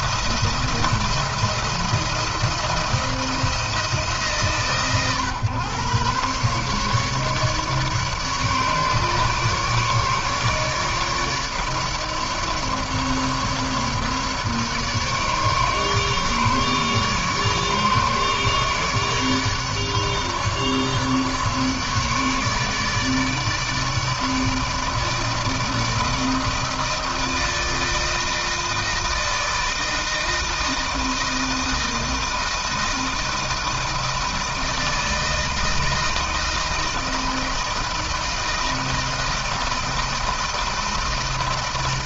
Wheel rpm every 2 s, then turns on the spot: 170, 170, 150, 140, 150, 150, 150, 150, 150, 150, 150, 150, 160, 160, 160, 160, 160, 160, 160, 160, 160.
none